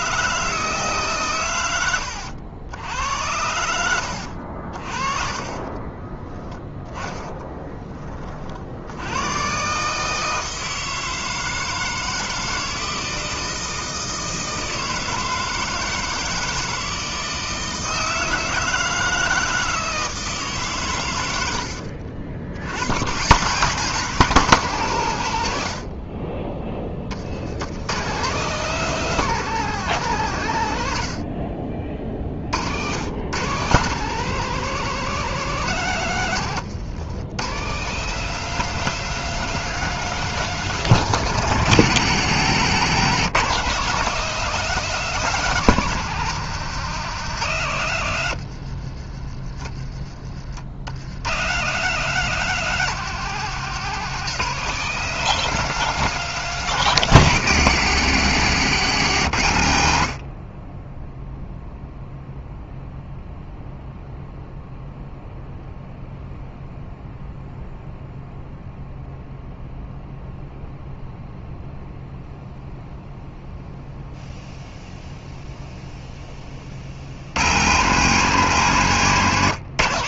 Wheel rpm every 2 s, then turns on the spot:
150, 70, 60, 0, 60, 160, 160, 160, 160, 160, 140, 80, 170, 30, 180, 110, 70, 180, 130, 200, 200, 160, 200, 180, 80, 60, 190, 180, 190, 140, 30, 0, 0, 0, 0, 0, 0, 0, 30, 160.
36-38 48-50